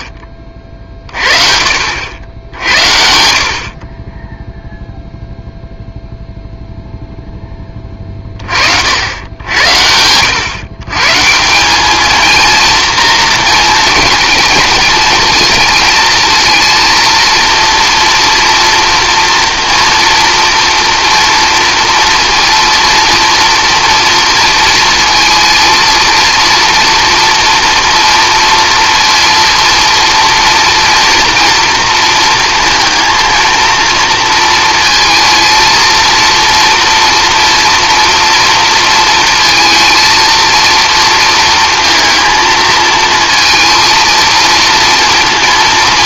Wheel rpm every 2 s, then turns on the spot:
40, 80, 0, 0, 50, 120, 230, 220, 230, 230, 230, 230, 230, 230, 240, 230, 230, 230, 230, 230, 230, 230, 230.
none